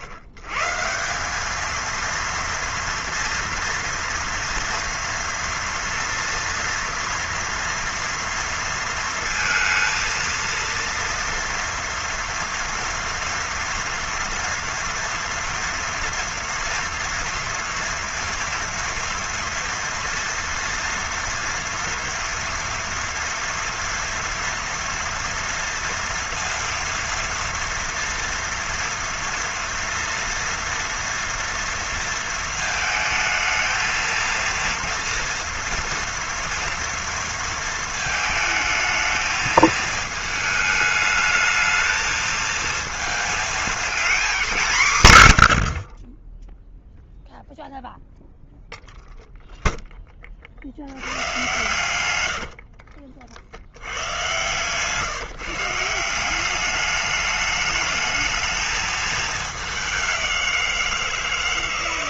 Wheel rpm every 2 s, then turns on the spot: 120, 230, 230, 230, 230, 230, 230, 230, 230, 230, 230, 230, 230, 230, 230, 230, 220, 230, 230, 220, 220, 230, 140, 0, 0, 80, 60, 140, 210, 220, 170.
52-54